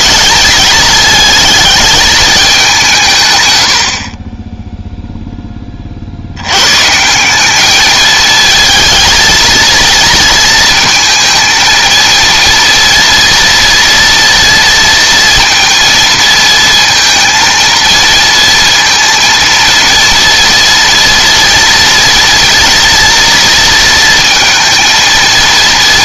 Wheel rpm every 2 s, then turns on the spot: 220, 190, 10, 120, 220, 230, 230, 230, 230, 230, 230, 230, 230.
none